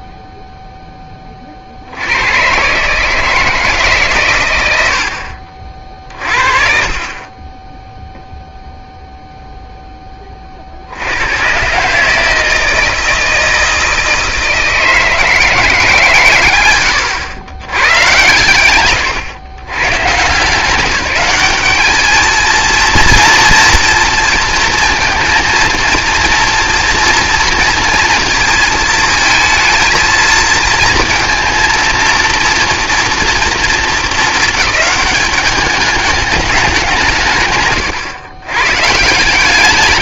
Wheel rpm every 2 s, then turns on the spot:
0, 130, 110, 40, 0, 70, 160, 160, 110, 110, 190, 230, 230, 230, 230, 230, 230, 210, 160, 160.
none